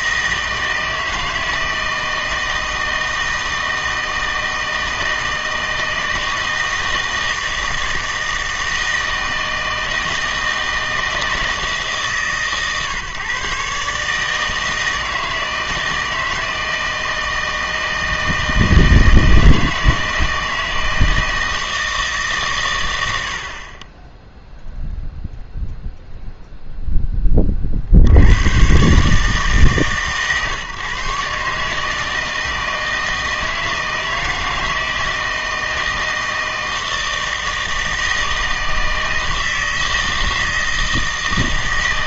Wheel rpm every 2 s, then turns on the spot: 160, 160, 160, 160, 160, 160, 140, 160, 160, 160, 160, 110, 0, 0, 120, 140, 160, 160, 160, 160, 160.
none